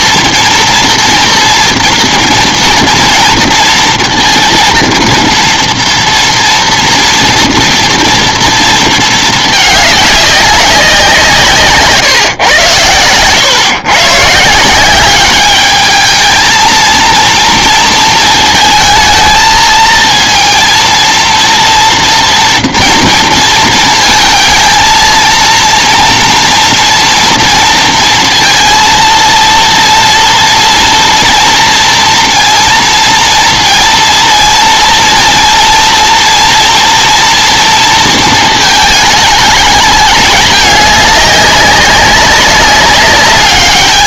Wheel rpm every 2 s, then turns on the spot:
230, 230, 230, 230, 230, 190, 110, 170, 230, 220, 230, 230, 230, 240, 230, 230, 230, 230, 230, 220, 210, 200.
12-14